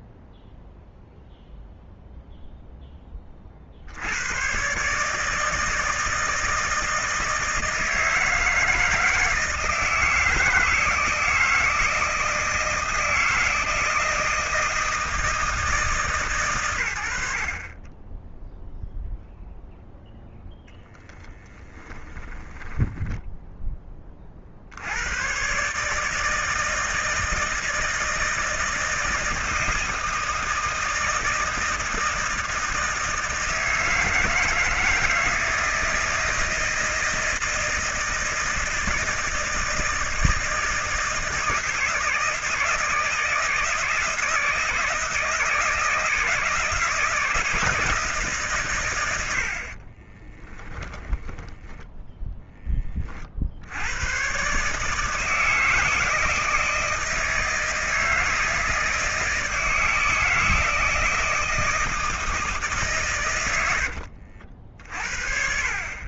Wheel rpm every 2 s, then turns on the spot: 0, 10, 130, 160, 160, 160, 160, 160, 110, 0, 0, 10, 80, 160, 160, 160, 160, 160, 160, 160, 160, 160, 160, 160, 110, 10, 30, 150, 160, 160, 160, 150, 60.
22-24 50-52